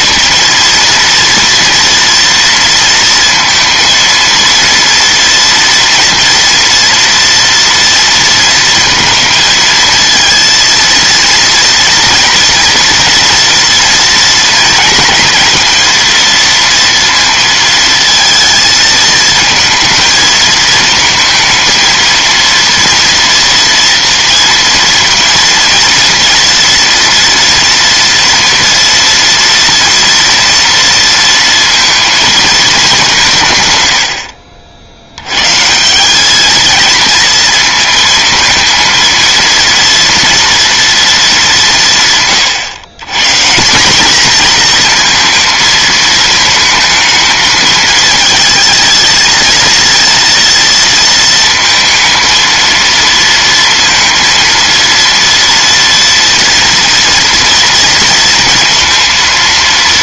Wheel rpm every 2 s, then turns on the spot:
230, 230, 230, 230, 230, 230, 240, 230, 230, 220, 220, 230, 230, 230, 230, 230, 220, 70, 220, 230, 230, 120, 230, 220, 220, 230, 230, 230, 230, 230.
none